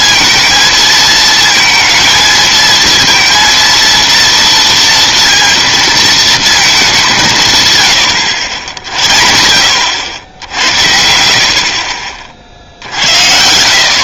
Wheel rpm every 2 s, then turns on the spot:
220, 230, 220, 90, 80, 40, 150.
none